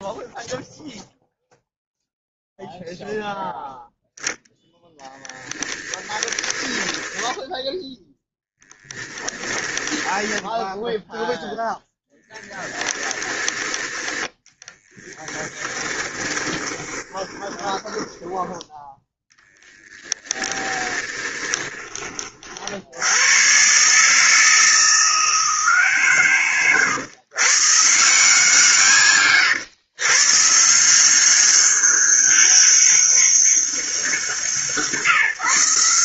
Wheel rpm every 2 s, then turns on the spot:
0, 0, 10, 10, 10, 0, 10, 30, 20, 10, 10, 70, 170, 130, 140, 160, 200, 160.
6-10 12-18 20-22